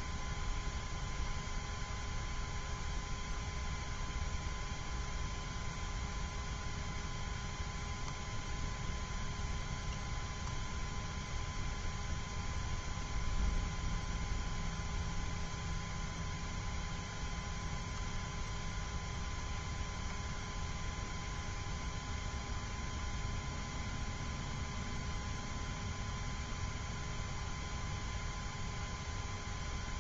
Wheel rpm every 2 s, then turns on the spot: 0, 0, 0, 0, 0, 0, 0, 0, 0, 0, 0, 0, 0, 0, 0.
none